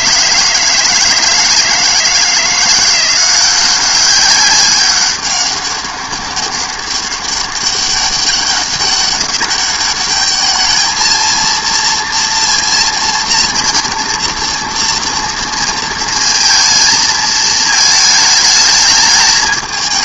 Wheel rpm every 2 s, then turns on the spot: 160, 170, 200, 200, 200, 210, 230, 230, 230, 210.
none